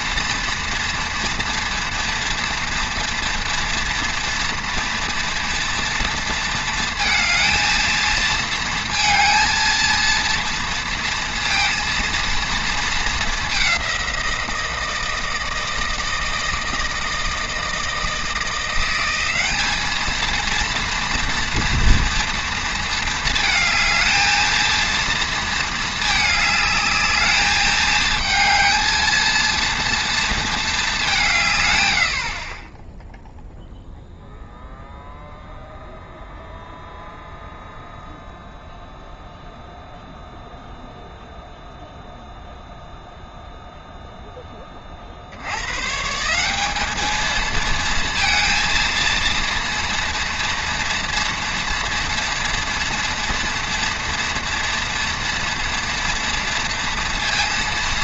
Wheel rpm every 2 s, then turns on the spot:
240, 230, 230, 230, 230, 230, 230, 170, 160, 170, 230, 230, 220, 220, 220, 210, 20, 0, 0, 0, 0, 0, 20, 200, 230, 230, 230, 240, 230.
none